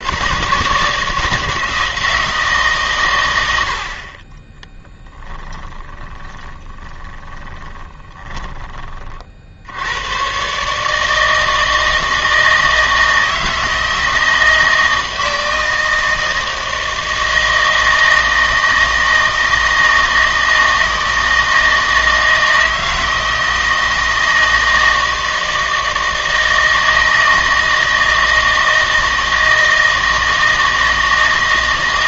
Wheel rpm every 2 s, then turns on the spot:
150, 140, 20, 20, 30, 150, 160, 160, 160, 160, 160, 160, 160, 160, 160, 160.
4-8